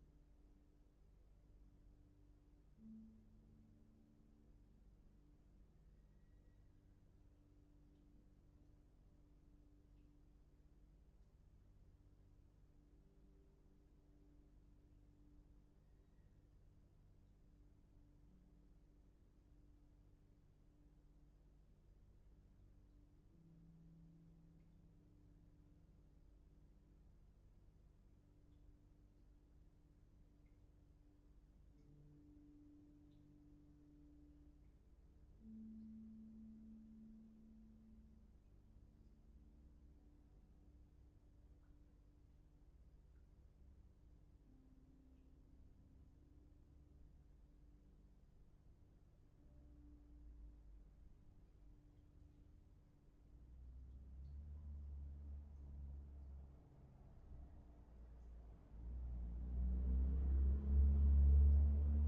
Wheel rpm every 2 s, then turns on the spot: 0, 0, 0, 0, 0, 0, 0, 0, 0, 0, 0, 0, 0, 0, 0, 0, 0, 0, 0, 0, 0, 0, 0, 0, 0, 0, 0, 0, 0, 0, 0.
none